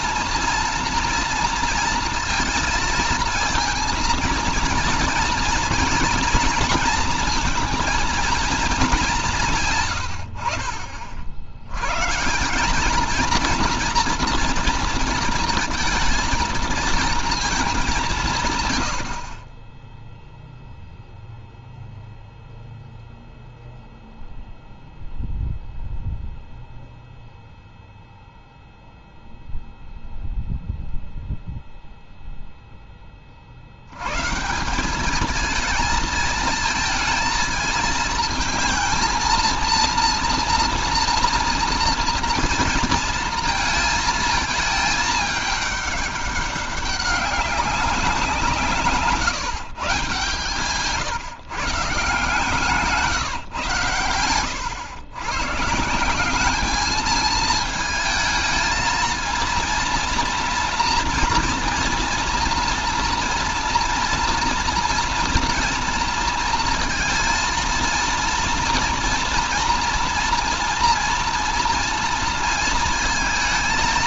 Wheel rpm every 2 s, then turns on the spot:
230, 230, 230, 230, 210, 60, 200, 230, 220, 110, 0, 0, 0, 0, 0, 0, 10, 180, 220, 230, 230, 230, 220, 190, 150, 140, 170, 110, 210, 230, 230, 230, 240, 230, 230, 230, 230.
none